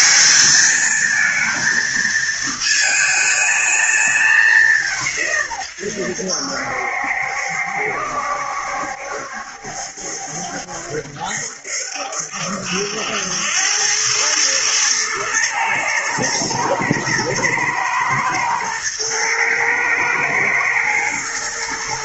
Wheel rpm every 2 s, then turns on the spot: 220, 220, 190, 80, 70, 70, 70, 110, 110, 110, 110.
none